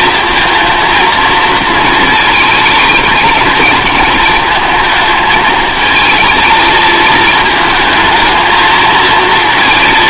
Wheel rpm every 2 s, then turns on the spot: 230, 210, 220, 220, 220.
none